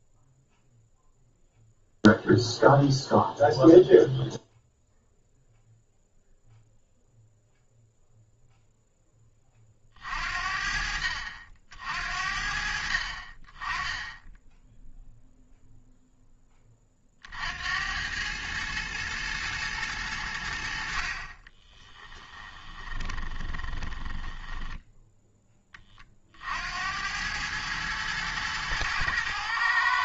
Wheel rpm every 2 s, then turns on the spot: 0, 0, 0, 0, 10, 60, 50, 0, 30, 110, 50, 20, 10, 80, 110.
22-24